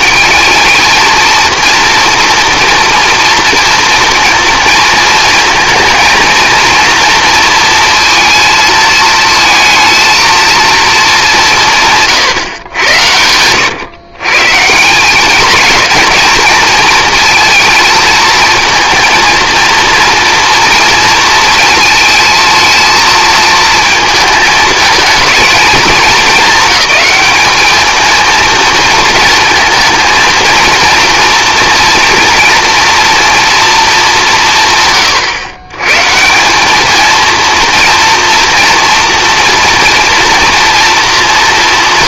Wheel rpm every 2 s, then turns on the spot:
220, 230, 230, 230, 220, 230, 120, 160, 220, 220, 230, 220, 220, 220, 230, 230, 240, 160, 200, 240, 230.
none